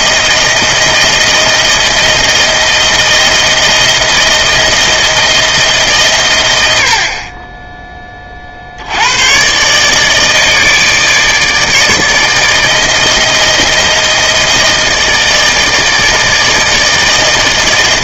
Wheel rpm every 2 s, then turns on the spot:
160, 160, 160, 100, 50, 160, 160, 160, 160.
none